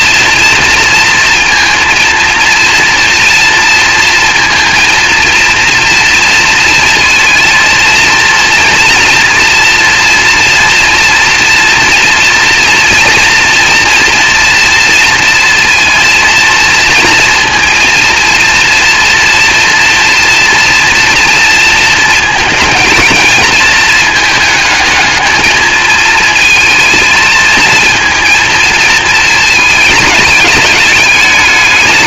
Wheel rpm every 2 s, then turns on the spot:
230, 240, 230, 230, 230, 240, 230, 230, 230, 230, 230, 220, 220, 220, 230, 200.
none